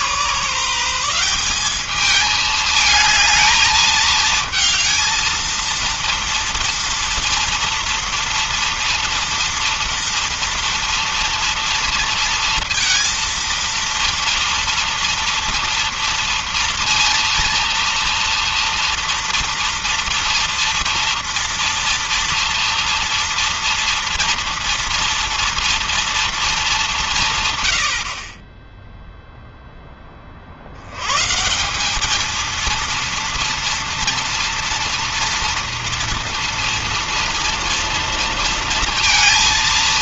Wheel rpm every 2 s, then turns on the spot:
160, 210, 220, 230, 230, 230, 230, 230, 230, 230, 230, 240, 230, 220, 30, 50, 220, 230, 230, 230.
none